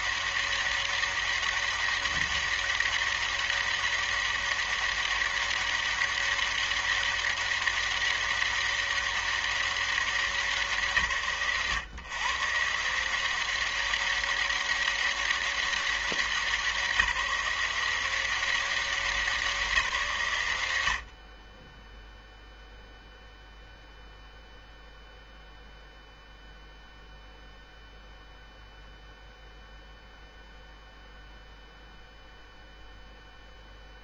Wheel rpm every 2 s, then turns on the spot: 200, 200, 200, 200, 200, 200, 130, 200, 190, 180, 170, 0, 0, 0, 0, 0, 0.
none